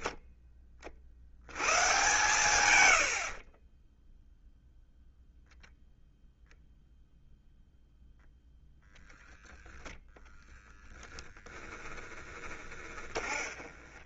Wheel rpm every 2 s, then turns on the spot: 30, 110, 0, 0, 0, 10, 20.
12-14